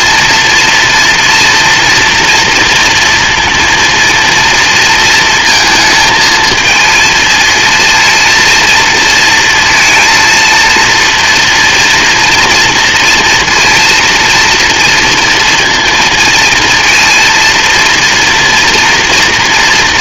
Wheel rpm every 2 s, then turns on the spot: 240, 230, 220, 230, 230, 240, 230, 230, 230, 230.
none